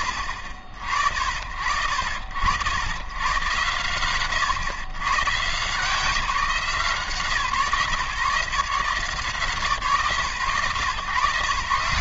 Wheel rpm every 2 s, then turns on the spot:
60, 70, 120, 150, 150, 120.
none